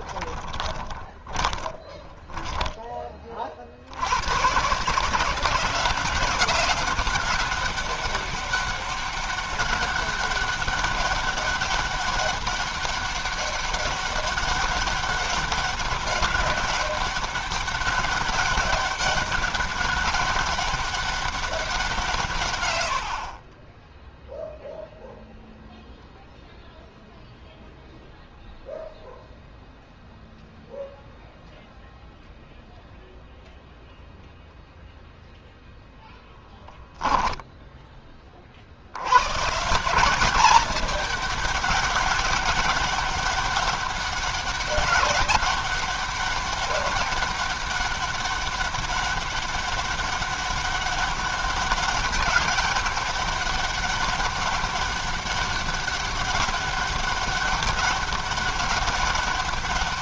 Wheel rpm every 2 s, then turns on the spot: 20, 20, 120, 190, 200, 200, 200, 200, 200, 200, 200, 150, 0, 0, 0, 0, 0, 0, 10, 40, 190, 200, 200, 190, 200, 200, 200, 200, 200, 200.
0-4